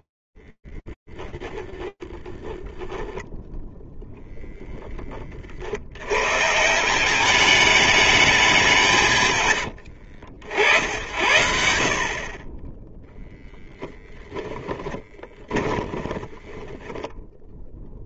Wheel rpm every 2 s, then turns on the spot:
10, 20, 0, 140, 190, 60, 20, 20, 20.
0-4 14-18